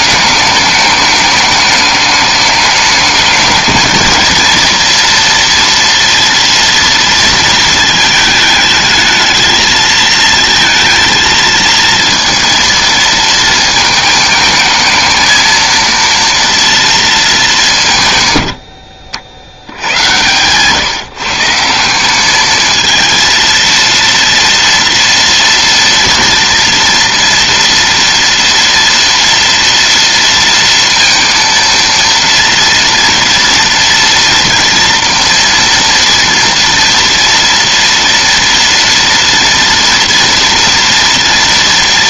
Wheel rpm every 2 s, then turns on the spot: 210, 210, 230, 230, 220, 230, 230, 220, 230, 80, 140, 220, 230, 240, 230, 230, 230, 230, 230, 240, 240.
none